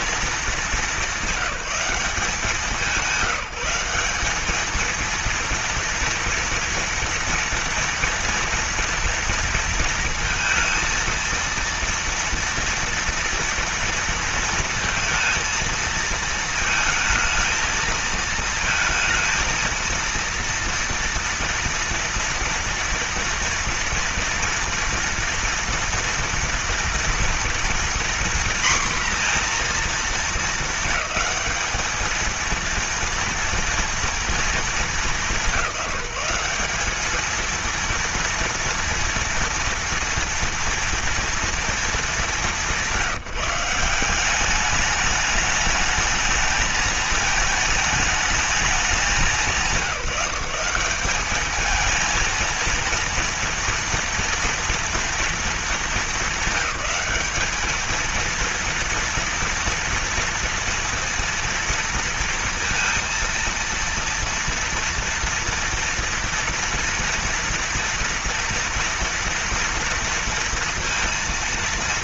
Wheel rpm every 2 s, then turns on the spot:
210, 170, 210, 230, 230, 230, 230, 230, 220, 220, 230, 230, 230, 230, 240, 220, 220, 220, 190, 230, 230, 190, 200, 220, 210, 170, 230, 230, 200, 230, 230, 230, 230, 240, 230, 230.
none